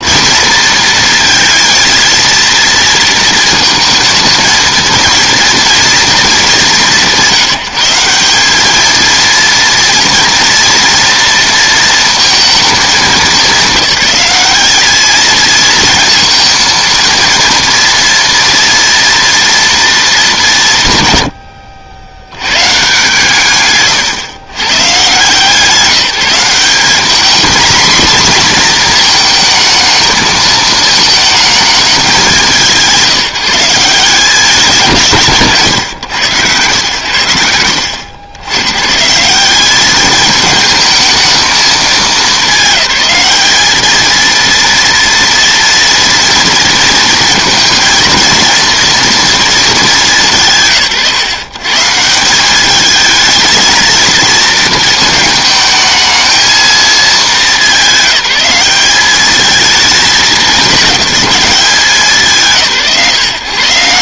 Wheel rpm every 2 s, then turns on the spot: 230, 230, 230, 190, 220, 230, 210, 210, 230, 230, 170, 130, 110, 190, 230, 220, 160, 170, 130, 130, 220, 200, 230, 230, 230, 140, 210, 220, 220, 190, 200, 140.
none